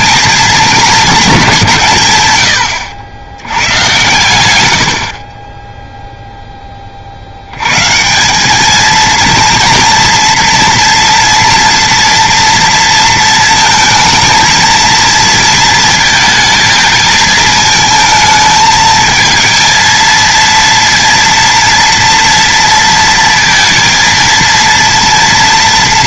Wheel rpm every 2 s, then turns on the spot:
220, 90, 90, 10, 210, 230, 230, 230, 220, 220, 230, 230, 230.
none